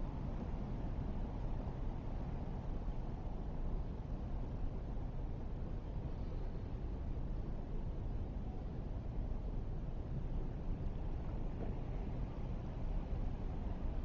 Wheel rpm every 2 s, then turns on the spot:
0, 0, 0, 0, 0, 0, 0.
none